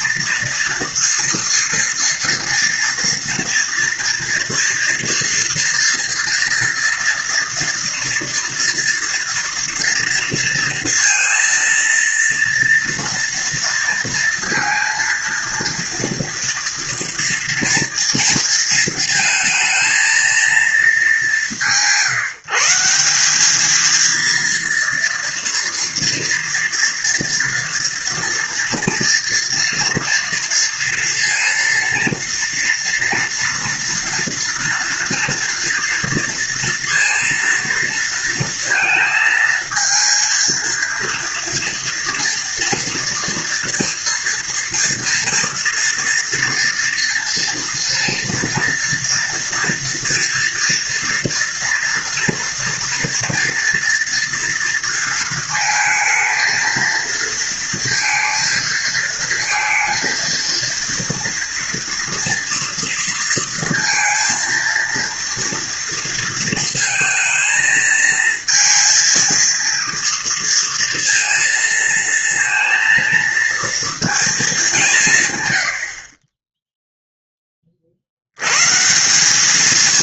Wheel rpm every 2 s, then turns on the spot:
230, 230, 230, 240, 240, 230, 230, 230, 230, 230, 220, 180, 230, 230, 240, 230, 230, 230, 230, 230, 230, 230, 230, 230, 230, 240, 230, 230, 230, 220, 230, 230, 230, 230, 230, 230, 230, 210, 10, 120.
none